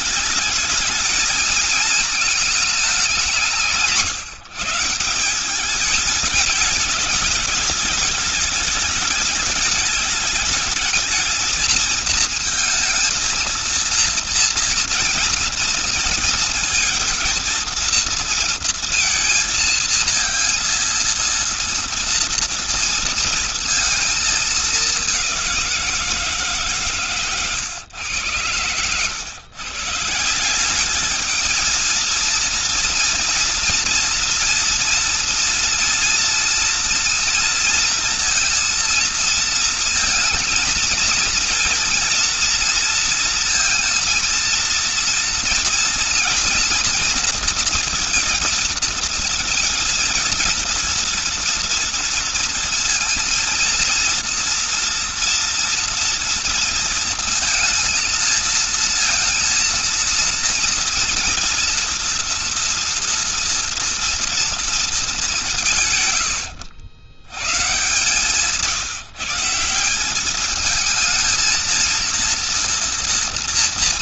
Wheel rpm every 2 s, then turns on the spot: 220, 210, 160, 210, 210, 210, 230, 230, 230, 230, 230, 230, 210, 140, 110, 180, 230, 240, 230, 230, 220, 230, 230, 230, 230, 230, 230, 230, 230, 230, 230, 230, 230, 100, 150, 200, 230.
none